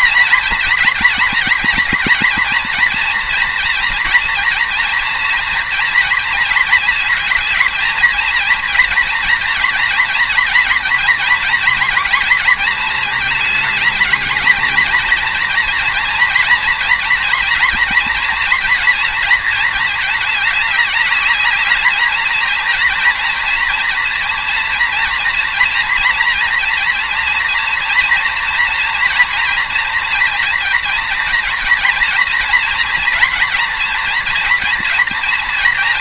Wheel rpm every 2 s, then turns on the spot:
230, 230, 230, 220, 230, 240, 220, 230, 230, 230, 210, 230, 230, 240, 230, 230, 240, 240.
none